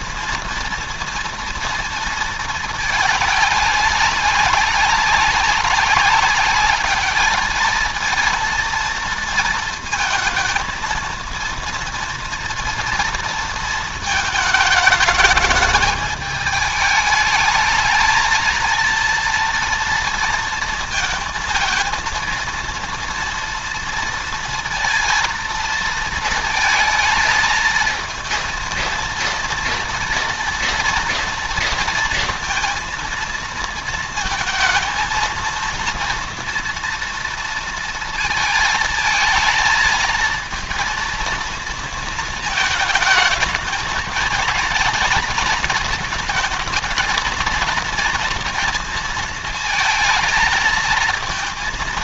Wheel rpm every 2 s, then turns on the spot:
230, 220, 200, 200, 230, 230, 230, 220, 210, 230, 230, 230, 230, 220, 230, 230, 230, 230, 240, 220, 230, 220, 220, 220, 230, 230.
none